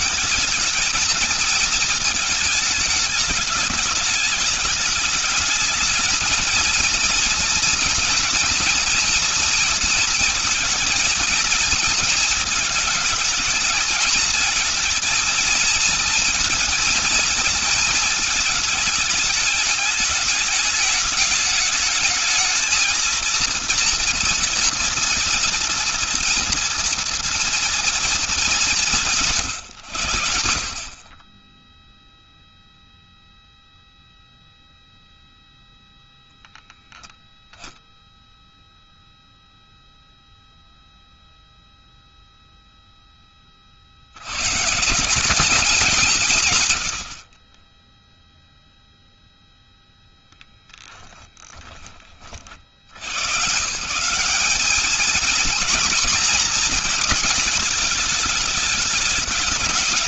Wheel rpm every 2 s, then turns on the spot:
220, 220, 210, 220, 230, 230, 220, 220, 230, 210, 210, 220, 230, 230, 200, 70, 0, 0, 0, 0, 0, 0, 120, 120, 0, 0, 50, 200, 240, 210.
none